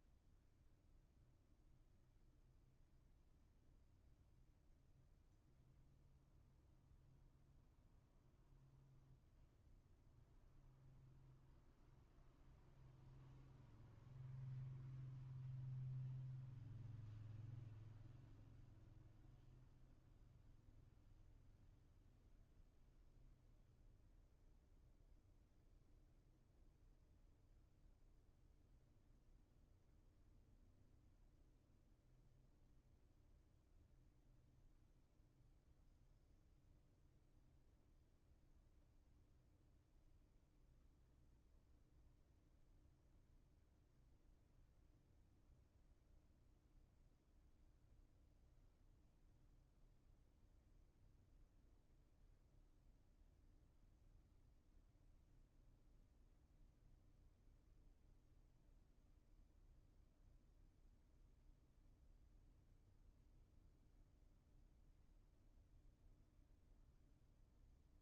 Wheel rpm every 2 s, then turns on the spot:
0, 0, 0, 0, 0, 0, 0, 0, 0, 0, 0, 0, 0, 0, 0, 0, 0, 0, 0, 0, 0, 0, 0, 0, 0, 0, 0, 0, 0, 0, 0, 0, 0, 0.
none